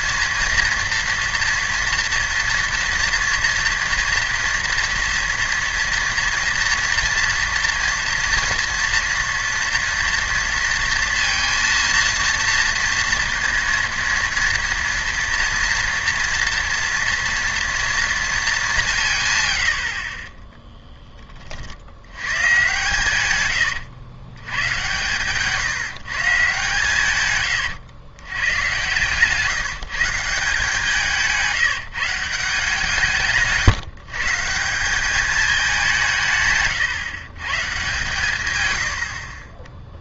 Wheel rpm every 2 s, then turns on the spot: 240, 230, 230, 230, 230, 230, 230, 230, 230, 210, 10, 110, 120, 150, 120, 170, 170, 180, 140, 130.
20-22